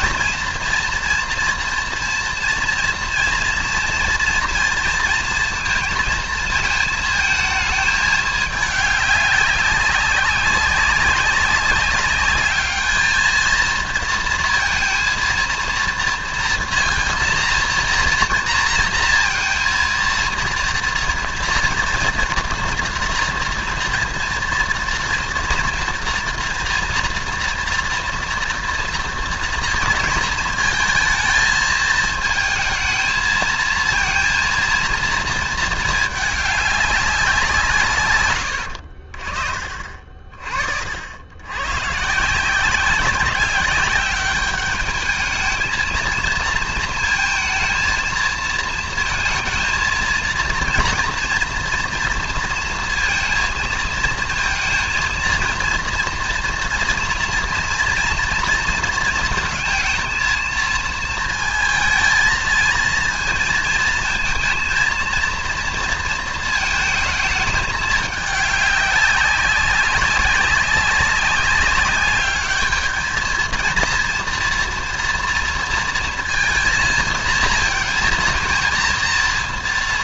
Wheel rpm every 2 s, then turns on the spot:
230, 240, 230, 220, 210, 190, 210, 230, 230, 230, 230, 230, 230, 230, 230, 230, 220, 230, 200, 60, 50, 180, 210, 230, 230, 230, 230, 220, 230, 220, 220, 230, 230, 220, 200, 190, 210, 230, 230, 230.
none